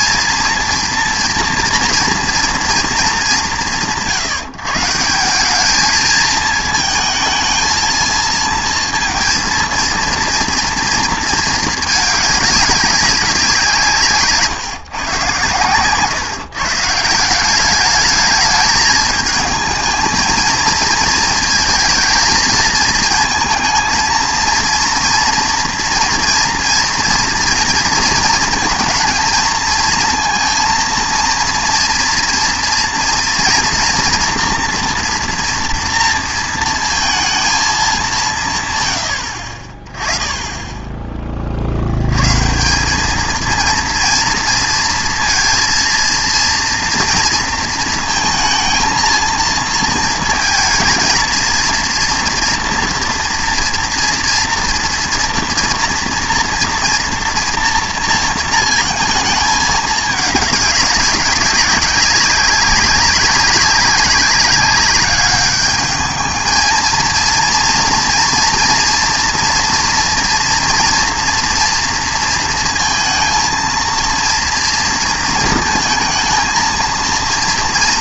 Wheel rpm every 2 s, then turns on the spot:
230, 230, 160, 220, 230, 230, 200, 150, 150, 210, 230, 220, 230, 240, 220, 230, 230, 230, 230, 130, 20, 150, 230, 230, 220, 230, 240, 240, 240, 220, 200, 190, 200, 220, 230, 240, 230, 230, 230.
none